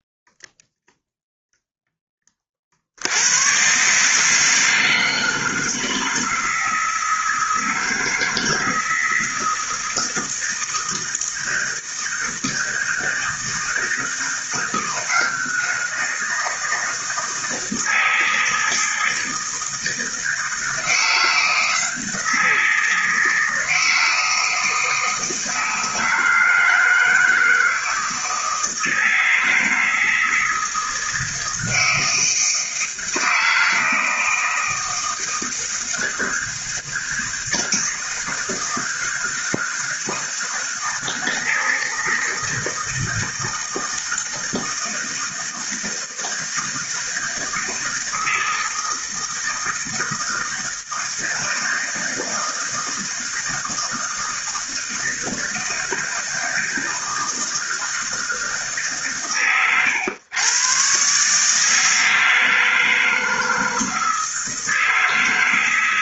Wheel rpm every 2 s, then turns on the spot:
0, 30, 160, 160, 160, 160, 160, 170, 160, 160, 160, 170, 160, 160, 160, 160, 160, 160, 160, 160, 160, 160, 160, 160, 160, 160, 160, 160, 160, 150, 120, 160, 160.
none